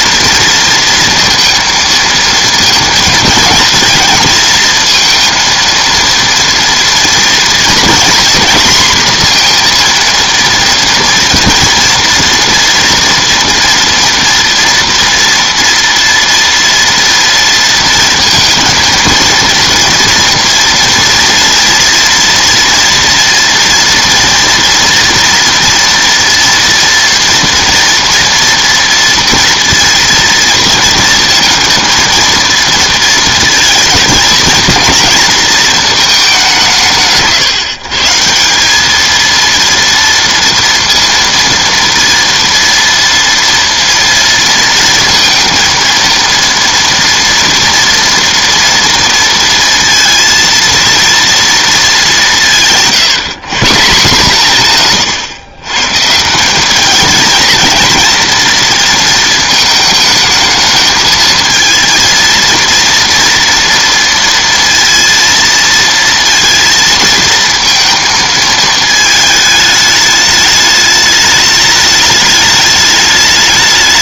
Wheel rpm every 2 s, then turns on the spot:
230, 220, 230, 230, 250, 230, 230, 230, 230, 230, 230, 240, 240, 240, 230, 230, 230, 230, 180, 180, 230, 230, 230, 230, 230, 230, 160, 150, 190, 230, 220, 230, 230, 230, 220, 210, 210.
none